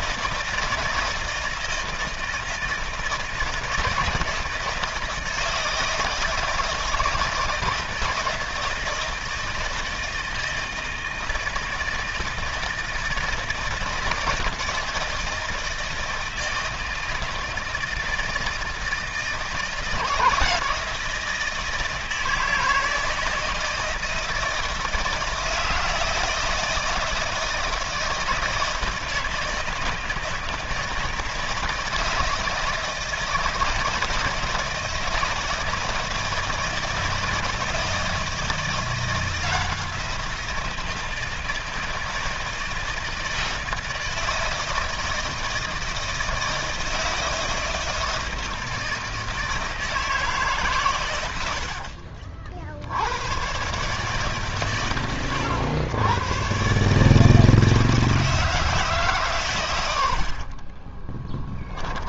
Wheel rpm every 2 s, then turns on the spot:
160, 160, 160, 160, 160, 160, 160, 160, 160, 160, 160, 160, 160, 160, 160, 160, 160, 160, 160, 170, 170, 160, 160, 160, 160, 150, 50, 130, 120, 160, 60.
60-62